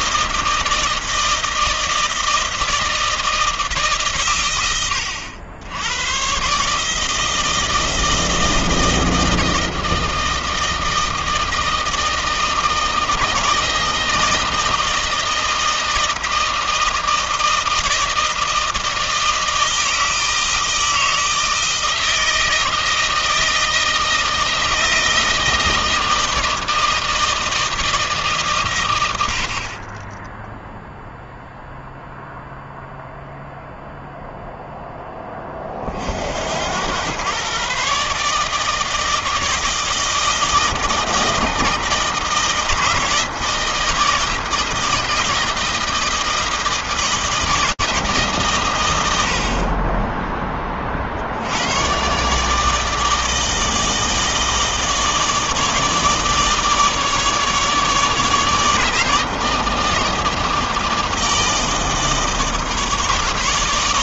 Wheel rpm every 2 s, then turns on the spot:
160, 160, 90, 160, 160, 160, 160, 160, 160, 160, 160, 160, 160, 160, 80, 0, 0, 20, 110, 160, 160, 160, 160, 160, 90, 50, 160, 160, 150, 160, 160, 160.
none